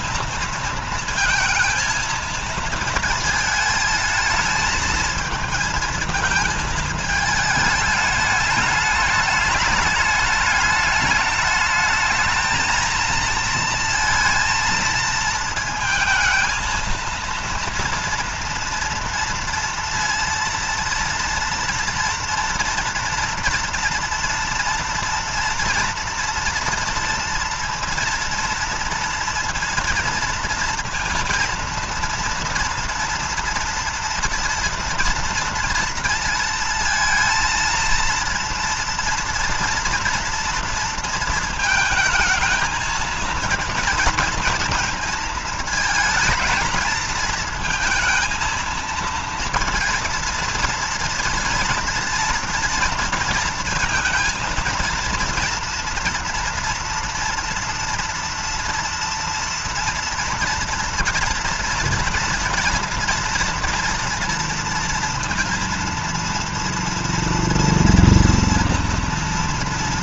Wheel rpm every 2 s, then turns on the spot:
230, 230, 220, 220, 210, 210, 220, 230, 230, 230, 230, 240, 230, 230, 230, 230, 230, 230, 230, 230, 230, 220, 230, 220, 230, 230, 230, 230, 230, 230, 230, 230, 230, 230, 230.
none